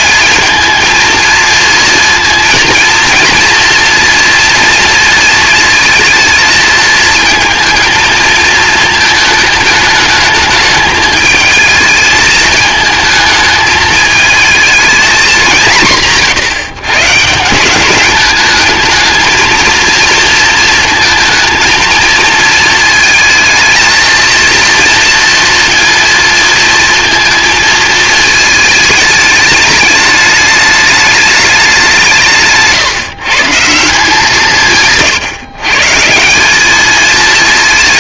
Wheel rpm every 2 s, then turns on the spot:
230, 230, 230, 220, 220, 220, 220, 190, 160, 230, 230, 230, 230, 230, 210, 200, 140, 150, 220.
none